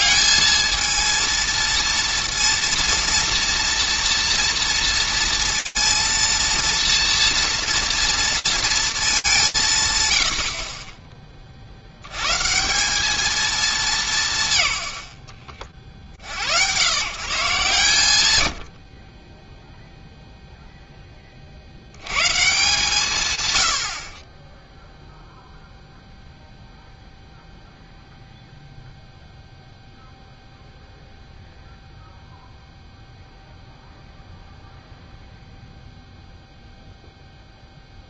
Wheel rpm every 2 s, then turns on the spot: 220, 230, 230, 230, 230, 50, 180, 110, 120, 40, 20, 120, 0, 0, 0, 0, 0, 0, 0.
none